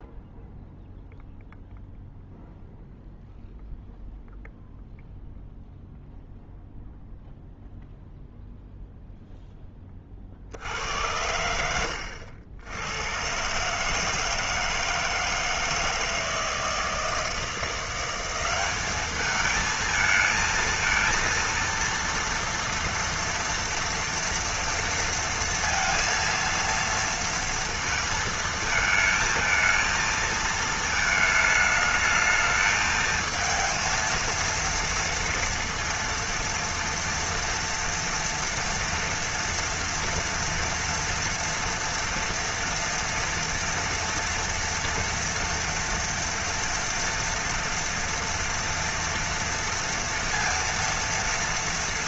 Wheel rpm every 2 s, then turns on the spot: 0, 0, 0, 0, 0, 80, 90, 160, 160, 210, 230, 230, 230, 230, 220, 220, 220, 230, 230, 230, 230, 230, 240, 240, 230, 230.
none